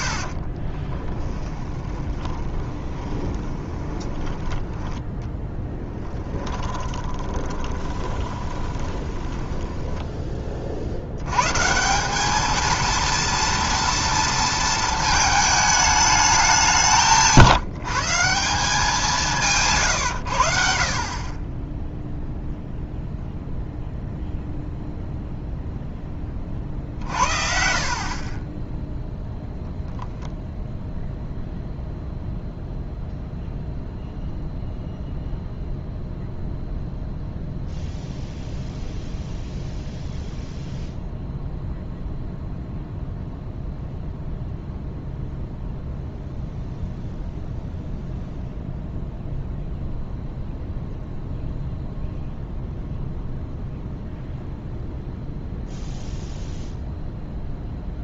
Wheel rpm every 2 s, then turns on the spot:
10, 20, 10, 20, 20, 80, 230, 220, 170, 180, 60, 0, 0, 50, 10, 0, 0, 0, 0, 0, 0, 0, 0, 0, 0, 0, 0, 0, 0.
0-4 6-10